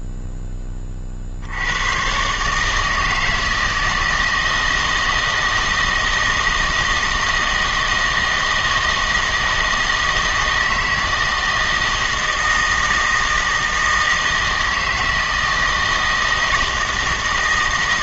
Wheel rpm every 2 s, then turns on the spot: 30, 160, 160, 160, 160, 160, 160, 160, 160.
none